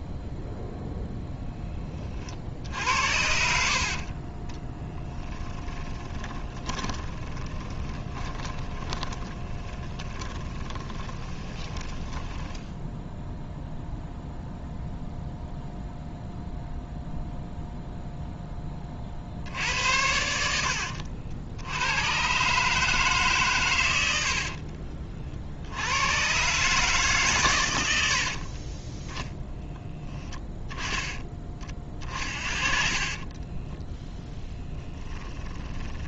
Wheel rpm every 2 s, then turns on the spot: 0, 70, 10, 20, 20, 20, 10, 0, 0, 40, 60, 150, 50, 150, 20, 10, 40, 20.
2-14 20-22 24-26 28-30 32-36